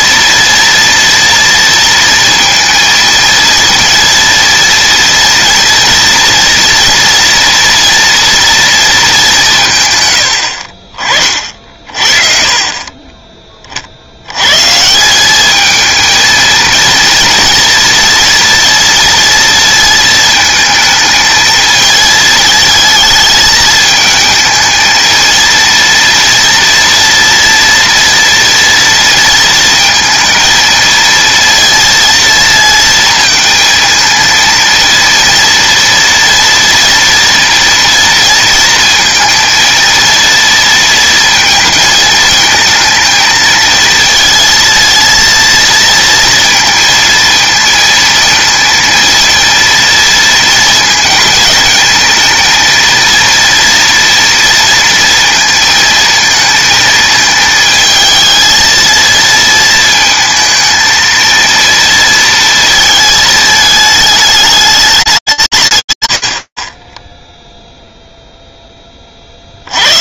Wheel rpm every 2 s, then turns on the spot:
230, 230, 230, 240, 230, 60, 30, 140, 230, 230, 230, 220, 220, 240, 230, 220, 230, 230, 230, 230, 230, 220, 230, 230, 230, 230, 230, 230, 230, 230, 220, 220, 200, 40, 20.
none